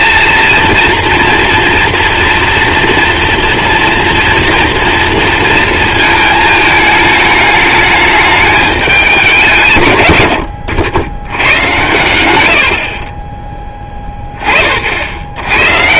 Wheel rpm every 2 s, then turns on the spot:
230, 230, 230, 220, 210, 70, 80, 50.
12-14